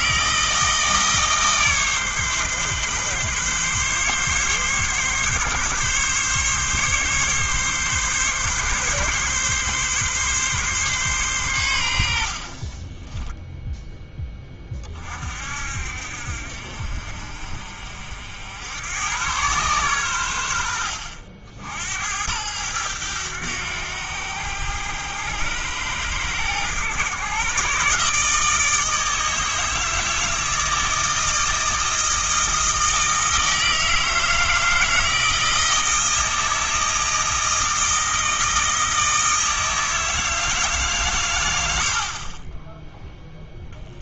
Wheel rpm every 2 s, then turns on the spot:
160, 140, 140, 140, 130, 140, 40, 30, 50, 90, 80, 100, 90, 110, 160, 160, 160, 160, 160, 160, 150, 10.
12-14